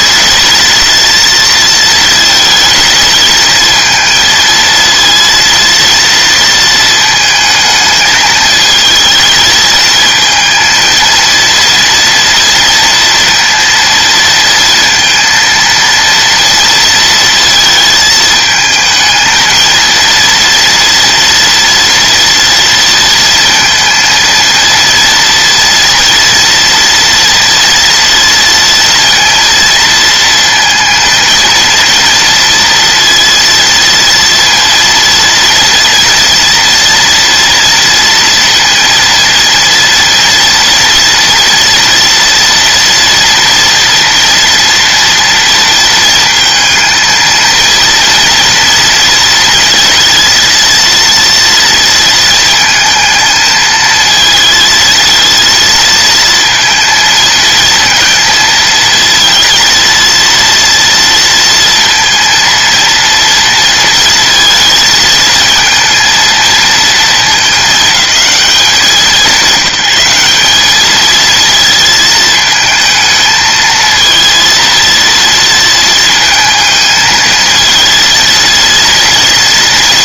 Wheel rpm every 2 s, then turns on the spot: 230, 220, 230, 230, 220, 230, 230, 230, 230, 220, 240, 230, 230, 240, 230, 230, 230, 230, 230, 230, 230, 230, 240, 220, 230, 230, 220, 220, 230, 230, 230, 230, 220, 220, 200, 210, 220, 230, 220, 230.
none